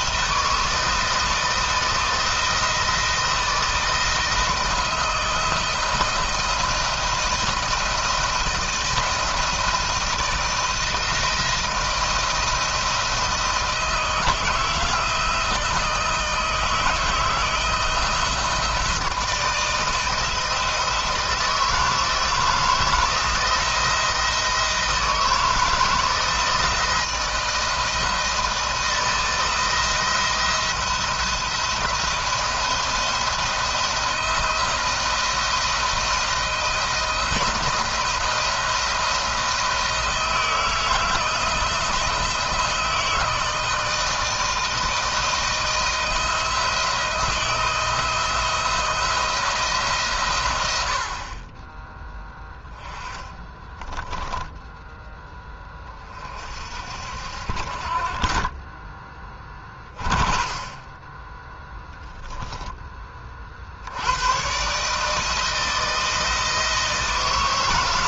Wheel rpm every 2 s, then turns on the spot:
160, 160, 170, 170, 170, 160, 160, 160, 160, 160, 160, 160, 160, 160, 170, 170, 170, 170, 170, 170, 160, 160, 160, 170, 160, 110, 10, 0, 50, 30, 30, 10, 120, 160.
58-60